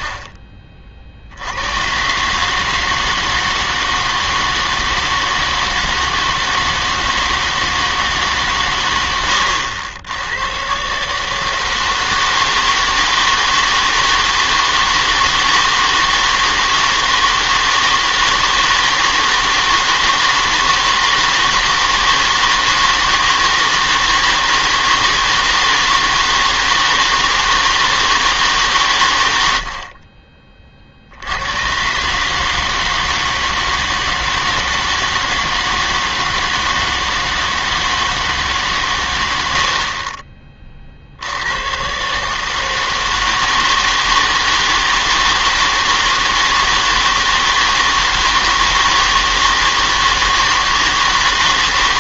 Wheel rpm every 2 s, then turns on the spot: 50, 150, 160, 160, 130, 120, 160, 160, 160, 160, 160, 160, 160, 160, 140, 40, 160, 160, 160, 140, 30, 160, 160, 160, 160, 160.
0-2